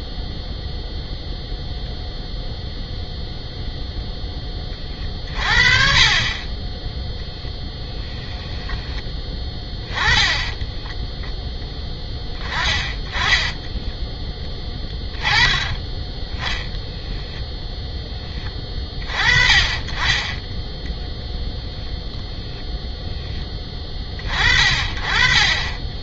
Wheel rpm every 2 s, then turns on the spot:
0, 0, 20, 10, 10, 10, 20, 10, 0, 30, 0, 0, 30.
12-16